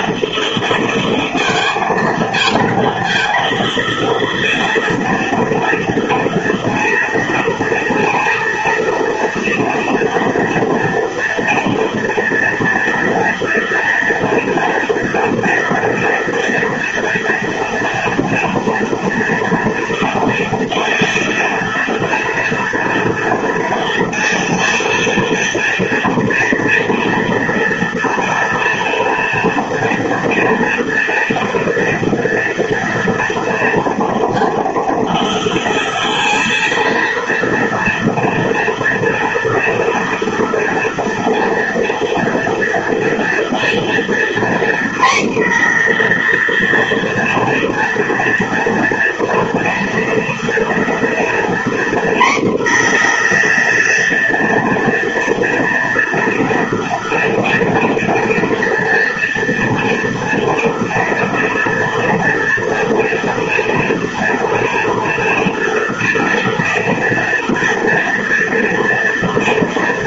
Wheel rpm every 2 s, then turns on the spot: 230, 230, 230, 230, 230, 230, 230, 230, 230, 230, 230, 230, 230, 230, 230, 230, 240, 230, 230, 230, 230, 240, 250, 240, 230, 240, 250, 230, 230, 230, 240, 230, 230, 230, 230.
none